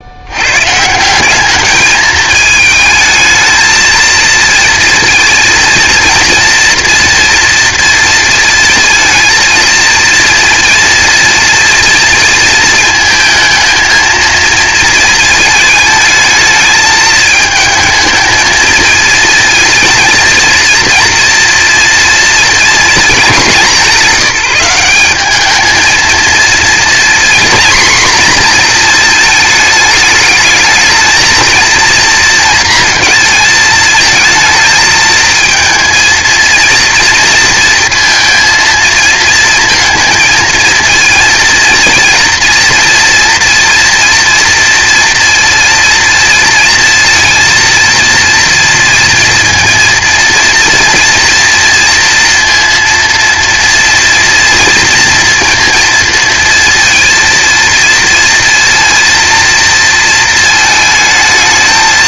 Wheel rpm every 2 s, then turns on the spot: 120, 220, 230, 230, 230, 230, 230, 230, 220, 220, 230, 230, 190, 230, 230, 220, 230, 230, 230, 230, 230, 230, 240, 230, 240, 230, 230, 230, 230, 230, 220.
none